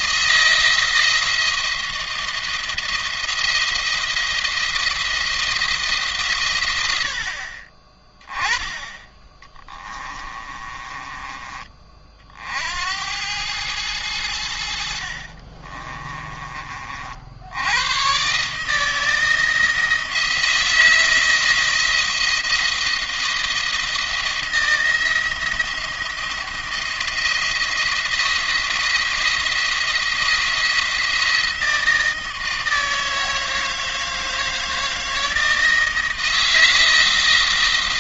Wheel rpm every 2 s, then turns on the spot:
170, 170, 170, 100, 10, 20, 80, 70, 40, 160, 170, 170, 170, 170, 170, 170, 160, 160, 160.
10-12